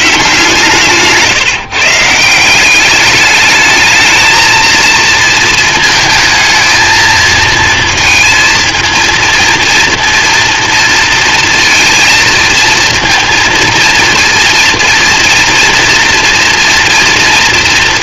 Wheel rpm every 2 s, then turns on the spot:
150, 190, 230, 220, 230, 240, 230, 230, 230.
none